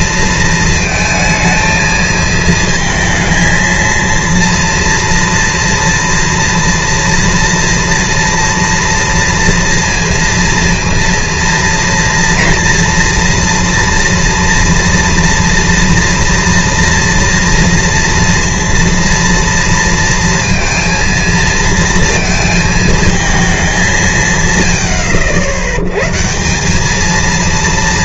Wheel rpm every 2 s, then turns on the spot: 230, 220, 230, 230, 230, 230, 240, 230, 230, 230, 230, 220, 110, 170.
none